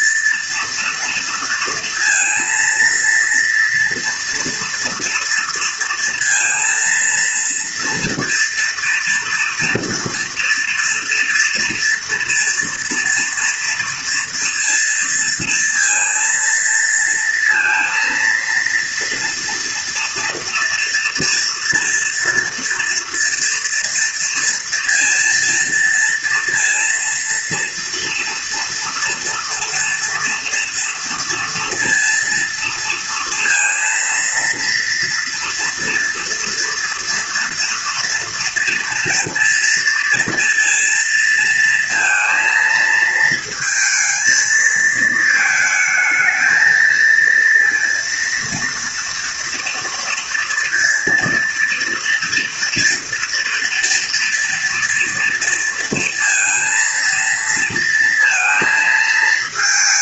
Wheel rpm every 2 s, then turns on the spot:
230, 230, 230, 230, 230, 230, 230, 230, 230, 230, 230, 230, 230, 230, 230, 230, 230, 230, 240, 230, 230, 230, 220, 220, 230, 230, 230, 230, 230, 220.
none